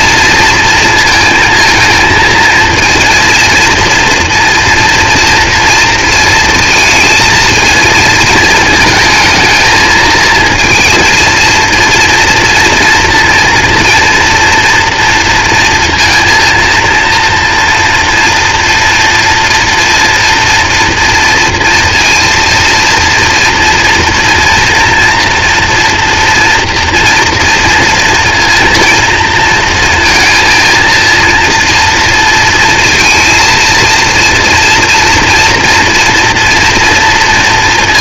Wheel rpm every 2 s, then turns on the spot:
230, 230, 230, 230, 220, 230, 230, 230, 230, 230, 230, 230, 230, 230, 230, 230, 230, 230, 230.
none